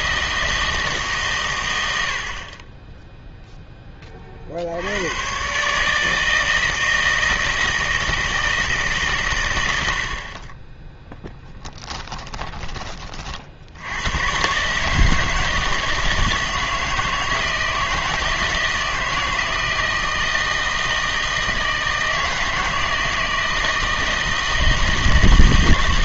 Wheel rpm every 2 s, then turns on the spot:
160, 20, 70, 160, 150, 20, 20, 140, 160, 160, 160, 160, 160.
none